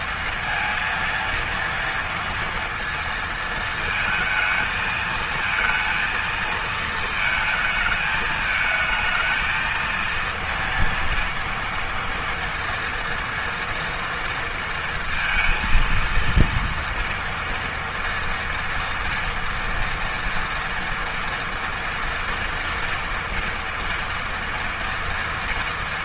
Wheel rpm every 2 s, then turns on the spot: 230, 230, 220, 220, 220, 230, 230, 230, 230, 230, 240, 230, 230.
none